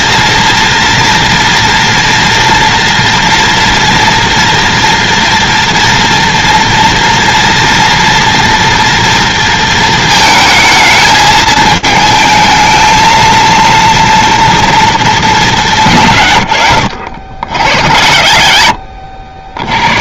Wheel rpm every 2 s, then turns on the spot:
230, 230, 230, 230, 230, 220, 220, 230, 60, 50.
none